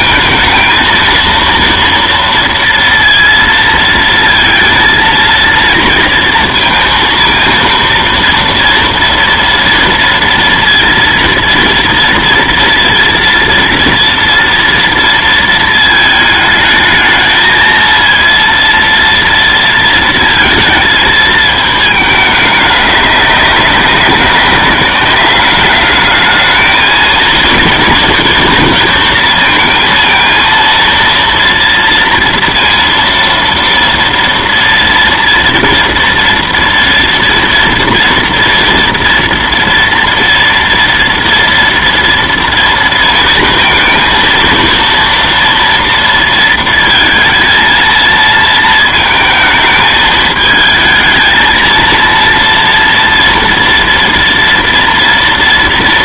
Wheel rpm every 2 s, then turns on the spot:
230, 230, 230, 230, 230, 230, 230, 230, 220, 230, 220, 200, 190, 220, 230, 230, 230, 230, 230, 230, 230, 230, 230, 230, 230, 220, 230, 230.
none